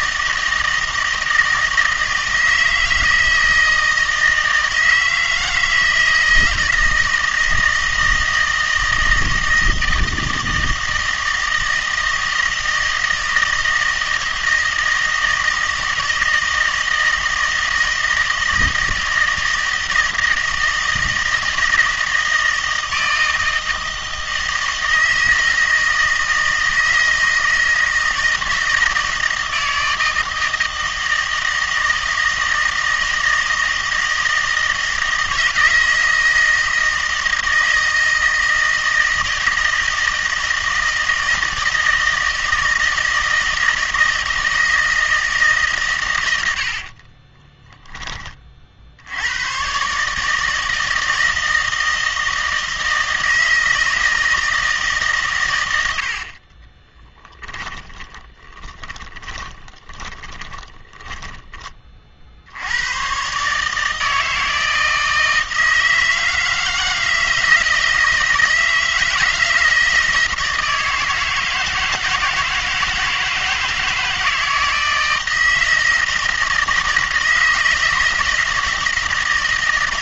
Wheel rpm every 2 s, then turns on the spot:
160, 160, 160, 160, 160, 160, 160, 160, 160, 160, 160, 160, 160, 160, 160, 160, 160, 160, 160, 160, 160, 160, 160, 80, 40, 160, 160, 160, 30, 30, 10, 70, 160, 160, 160, 160, 160, 160, 160, 160.
46-48 56-62